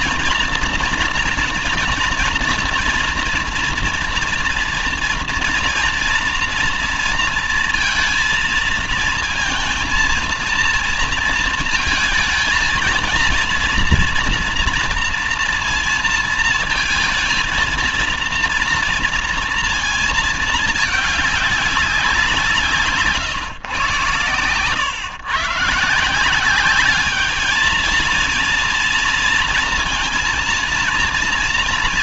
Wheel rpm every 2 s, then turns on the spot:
230, 230, 240, 230, 230, 230, 230, 230, 230, 230, 220, 160, 130, 190, 230, 230.
none